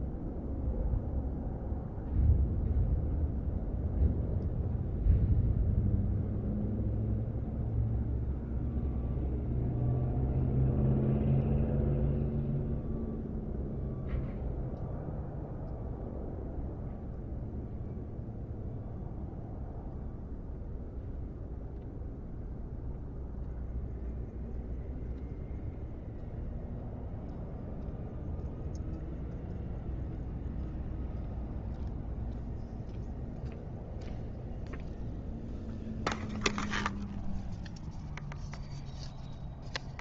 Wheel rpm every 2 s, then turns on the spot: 0, 0, 0, 0, 0, 0, 0, 0, 0, 0, 0, 0, 0, 0, 0, 0, 0, 0, 0, 0.
none